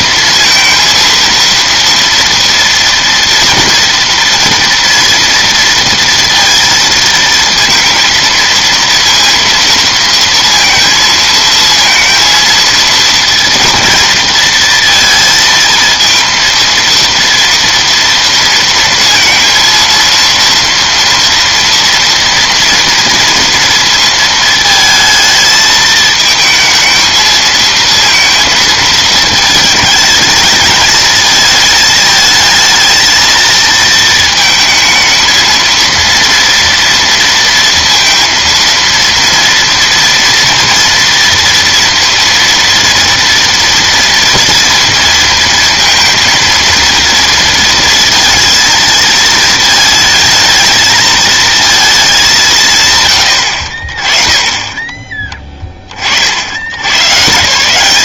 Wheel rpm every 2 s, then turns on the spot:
230, 230, 240, 230, 230, 230, 230, 230, 230, 230, 230, 230, 220, 220, 220, 220, 220, 220, 230, 230, 240, 230, 230, 230, 230, 220, 140, 20, 80.
none